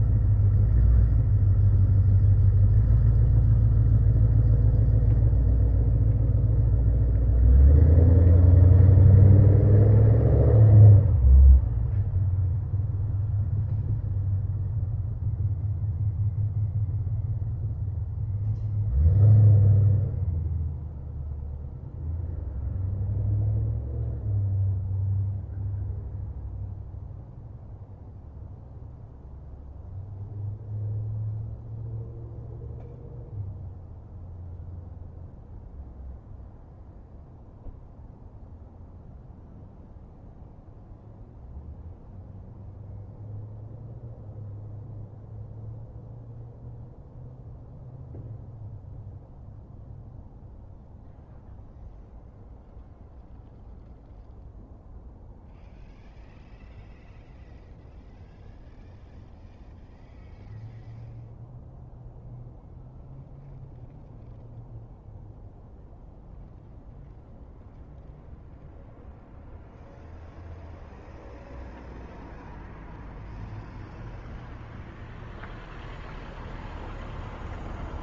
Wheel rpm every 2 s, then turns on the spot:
0, 0, 0, 0, 0, 0, 0, 0, 0, 0, 0, 0, 0, 0, 0, 0, 0, 0, 0, 0, 0, 0, 0, 0, 0, 0, 0, 0, 0, 0, 0, 0, 0, 0, 0, 0, 0, 0, 0.
none